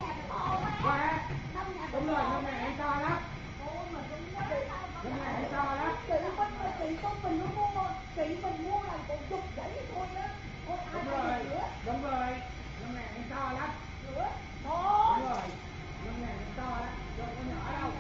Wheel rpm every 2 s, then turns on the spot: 0, 0, 0, 0, 0, 0, 0, 0, 0.
none